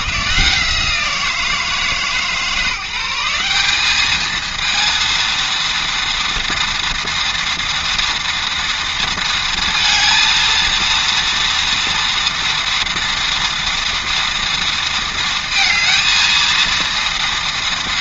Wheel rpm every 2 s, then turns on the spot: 110, 150, 220, 230, 230, 230, 230, 230, 220.
none